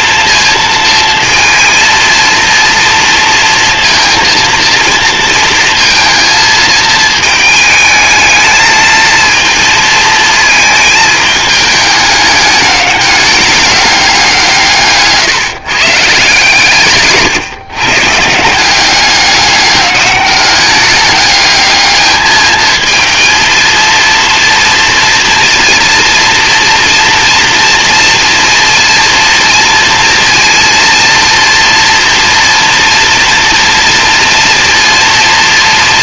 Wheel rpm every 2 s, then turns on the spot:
230, 230, 230, 220, 220, 220, 210, 150, 140, 190, 200, 220, 230, 230, 230, 230, 230, 230.
none